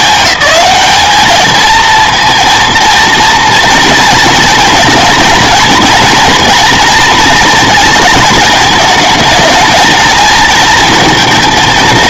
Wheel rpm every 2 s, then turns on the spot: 190, 230, 230, 240, 220, 230.
none